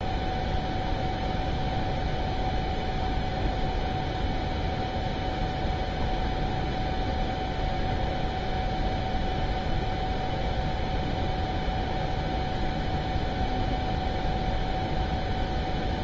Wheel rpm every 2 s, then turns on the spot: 0, 0, 0, 0, 0, 0, 0, 0.
none